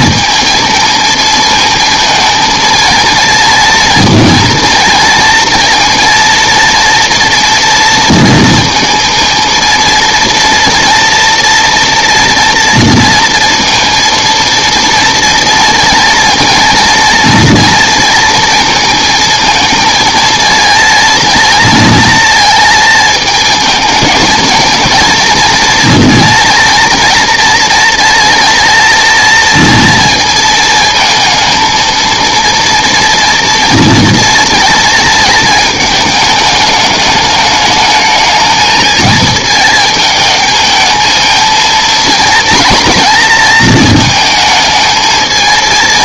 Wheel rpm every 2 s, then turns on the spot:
220, 230, 230, 230, 230, 240, 230, 230, 240, 230, 230, 220, 220, 230, 230, 230, 230, 230, 210, 220, 220, 230, 220.
none